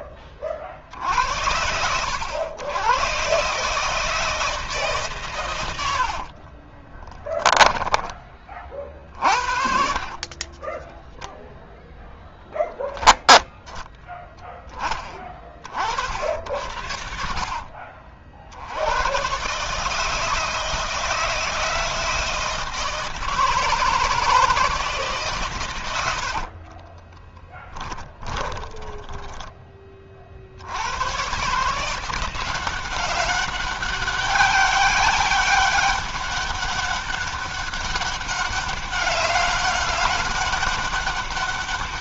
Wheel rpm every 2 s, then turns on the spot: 70, 120, 130, 10, 60, 0, 10, 20, 70, 80, 160, 160, 160, 40, 20, 80, 180, 200, 200, 190, 200.
6-10 26-30